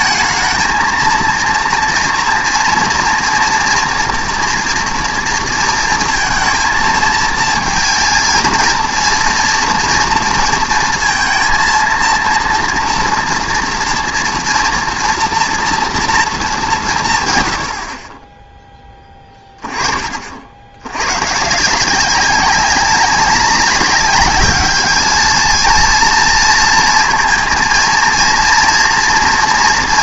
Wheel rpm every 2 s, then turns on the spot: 220, 230, 240, 230, 230, 230, 230, 230, 190, 10, 70, 190, 210, 230, 240.
none